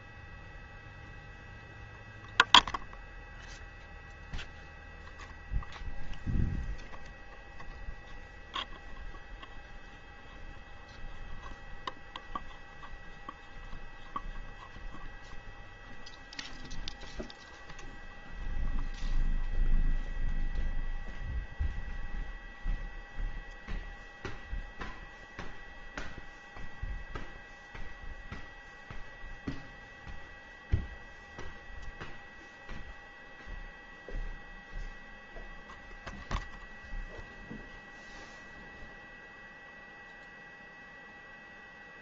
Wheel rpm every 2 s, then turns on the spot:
0, 0, 0, 0, 0, 0, 0, 0, 0, 0, 0, 0, 0, 0, 0, 0, 0, 0, 0, 0, 0.
none